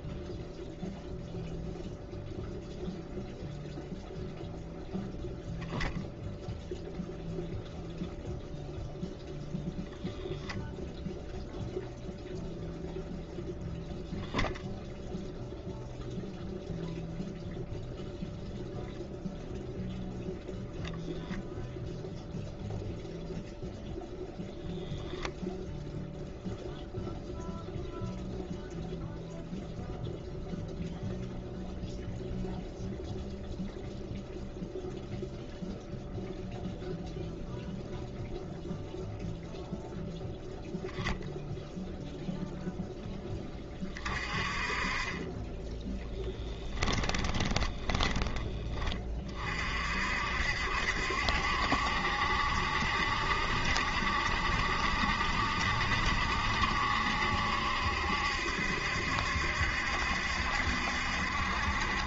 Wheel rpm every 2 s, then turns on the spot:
0, 0, 0, 0, 0, 0, 0, 0, 0, 0, 0, 0, 0, 0, 0, 0, 0, 0, 0, 0, 0, 0, 30, 10, 30, 60, 70, 70, 70, 70, 70.
46-48